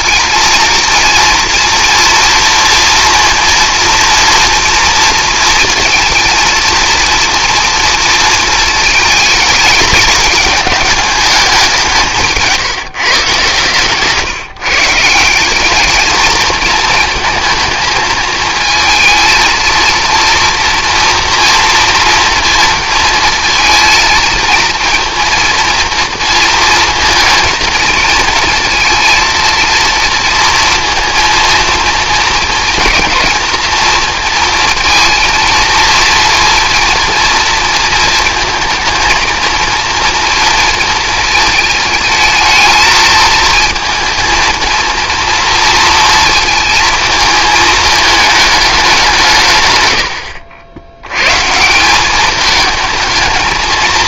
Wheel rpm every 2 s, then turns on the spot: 230, 230, 230, 230, 220, 210, 150, 150, 220, 220, 230, 230, 230, 230, 230, 230, 230, 230, 230, 230, 230, 220, 220, 230, 210, 70, 220.
none